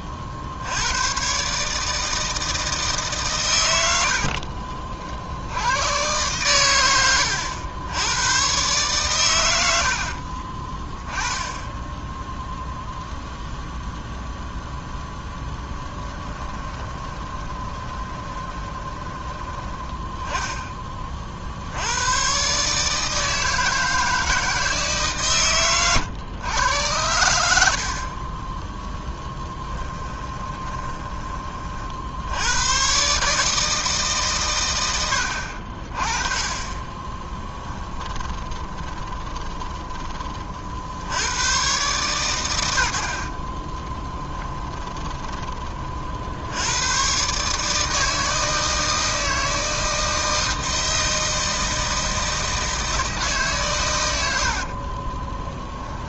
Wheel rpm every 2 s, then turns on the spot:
50, 160, 50, 110, 120, 30, 0, 0, 10, 20, 10, 140, 160, 100, 10, 20, 100, 120, 30, 20, 50, 100, 10, 80, 160, 160, 160, 60.
4-6 10-12 16-20 30-32 38-40 44-46 54-56